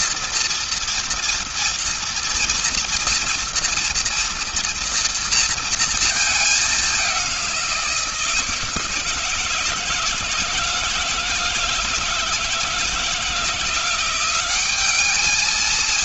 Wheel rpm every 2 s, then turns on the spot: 230, 230, 230, 180, 160, 160, 170, 210.
none